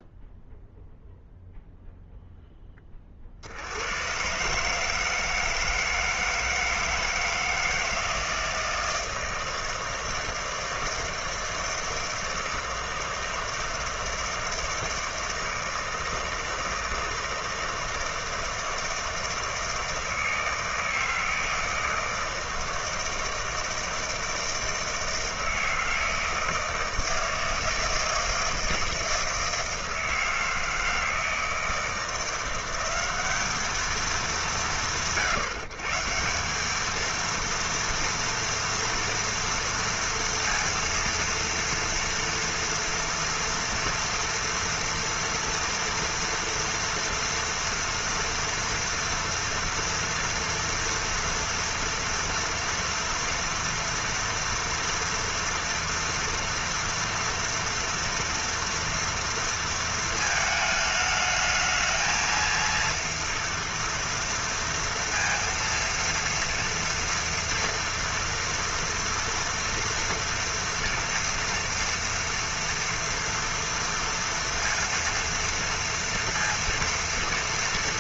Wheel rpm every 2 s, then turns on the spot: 0, 20, 150, 160, 160, 160, 160, 160, 160, 160, 160, 160, 160, 160, 160, 160, 170, 140, 200, 230, 230, 240, 230, 240, 230, 230, 230, 230, 230, 230, 220, 230, 230, 230, 230, 230, 240, 230, 230.
none